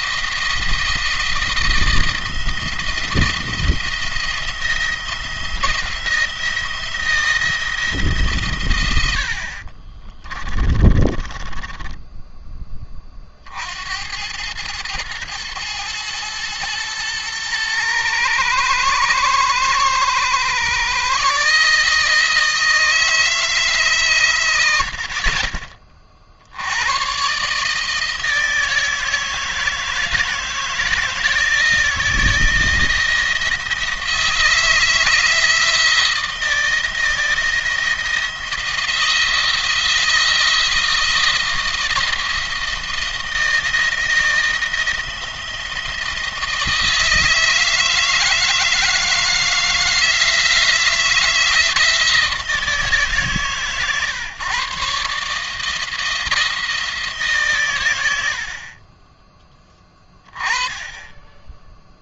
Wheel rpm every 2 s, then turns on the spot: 170, 170, 170, 170, 120, 30, 10, 100, 110, 110, 130, 160, 90, 80, 160, 160, 170, 160, 160, 170, 170, 170, 170, 160, 160, 160, 160, 140, 160, 50, 20.
10-12